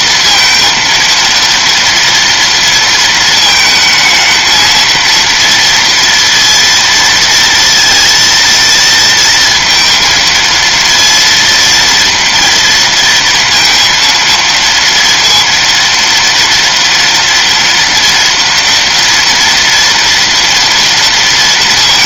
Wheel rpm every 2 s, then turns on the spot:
230, 230, 230, 230, 230, 230, 230, 230, 230, 240, 230.
none